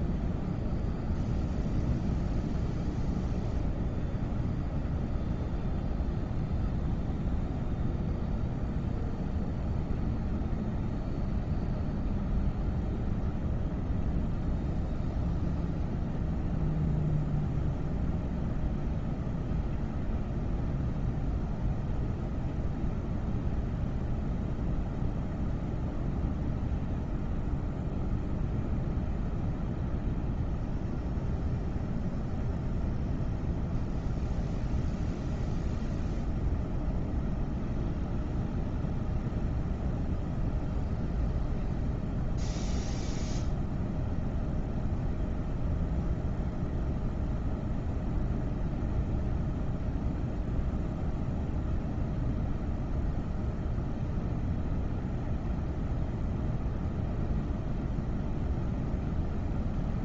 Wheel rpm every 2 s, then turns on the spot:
0, 0, 0, 0, 0, 0, 0, 0, 0, 0, 0, 0, 0, 0, 0, 0, 0, 0, 0, 0, 0, 0, 0, 0, 0, 0, 0, 0, 0, 0.
none